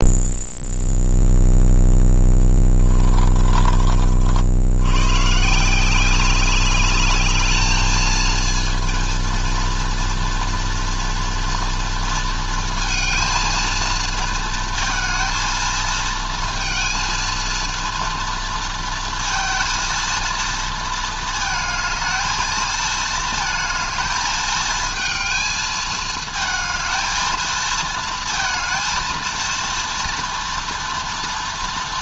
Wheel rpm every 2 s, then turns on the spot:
0, 20, 120, 210, 230, 230, 230, 220, 230, 230, 220, 220, 220, 220, 230, 230.
2-4